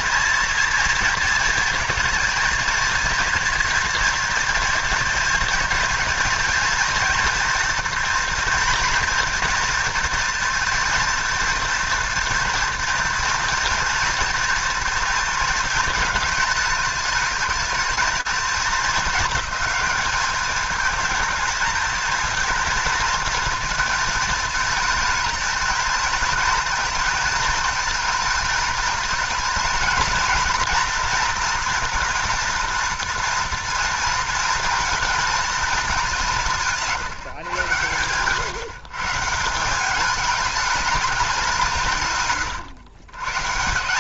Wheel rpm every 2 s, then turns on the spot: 230, 220, 230, 230, 230, 230, 230, 230, 210, 210, 210, 220, 220, 230, 220, 230, 240, 230, 160, 160, 200, 130.
none